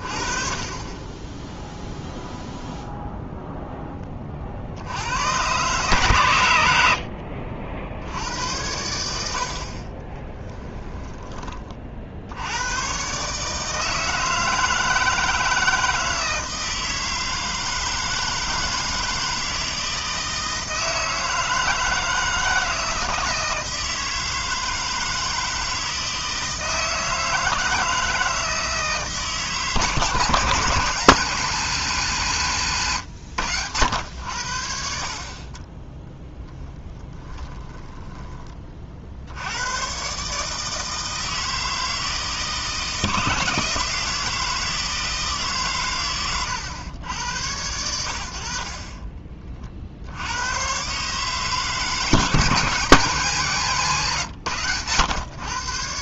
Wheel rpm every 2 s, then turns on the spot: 30, 0, 70, 80, 90, 10, 110, 160, 160, 160, 160, 160, 160, 160, 150, 150, 130, 60, 10, 40, 160, 160, 160, 100, 30, 120, 160, 110.
10-12 36-38